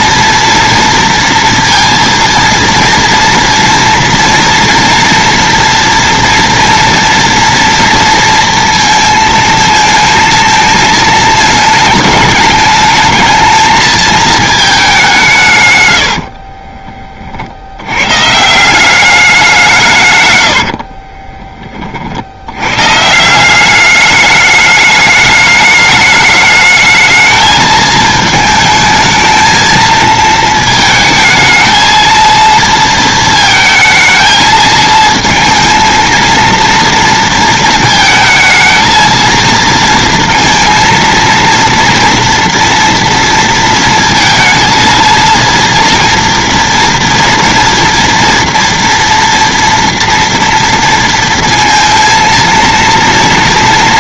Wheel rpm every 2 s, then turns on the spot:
230, 230, 230, 230, 230, 220, 210, 220, 40, 160, 80, 80, 210, 210, 220, 220, 230, 220, 230, 220, 230, 230, 230, 240, 240, 230, 230.
16-18 20-22